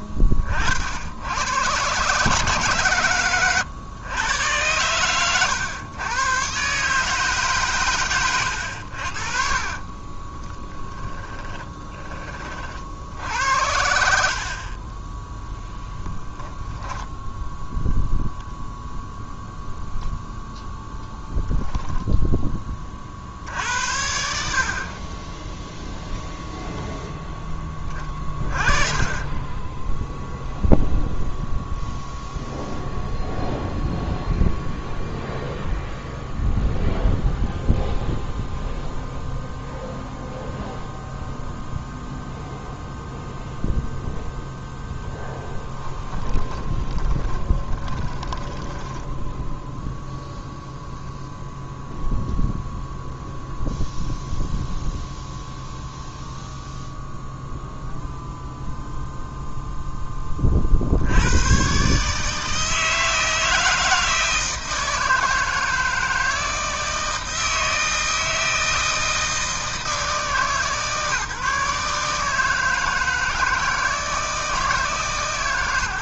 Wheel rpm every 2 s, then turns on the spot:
50, 130, 110, 140, 80, 10, 60, 30, 0, 0, 0, 30, 40, 0, 30, 0, 0, 0, 0, 0, 0, 0, 0, 20, 10, 0, 0, 0, 0, 0, 70, 160, 160, 160, 160, 150, 160, 160.
10-12 14-16 46-50